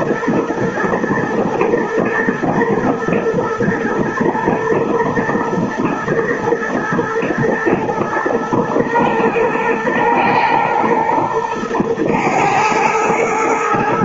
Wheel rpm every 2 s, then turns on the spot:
120, 110, 110, 120, 120, 120, 110.
none